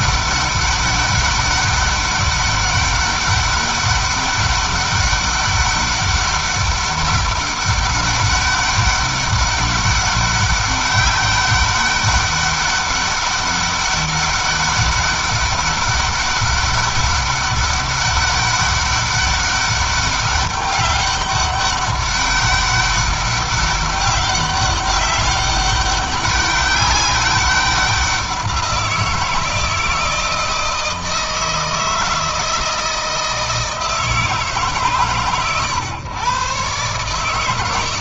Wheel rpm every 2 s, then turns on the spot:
200, 200, 200, 200, 200, 200, 200, 200, 200, 200, 200, 200, 200, 200, 180, 160, 160, 140, 130.
none